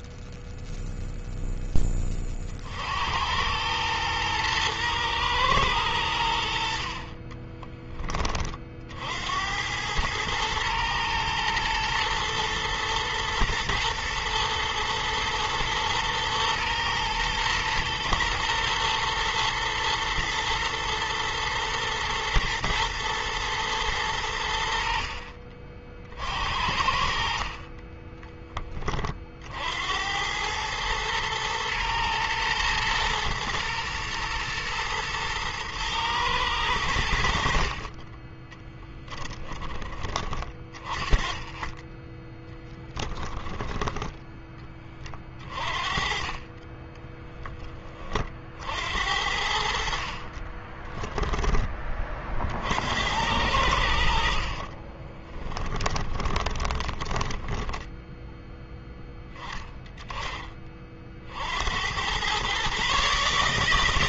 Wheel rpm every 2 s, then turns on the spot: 0, 70, 110, 40, 60, 110, 120, 120, 110, 110, 120, 120, 60, 50, 30, 110, 120, 110, 80, 10, 20, 20, 20, 20, 60, 10, 70, 50, 20, 0, 40, 140.
6-8 38-40 42-44 46-48 50-52 54-58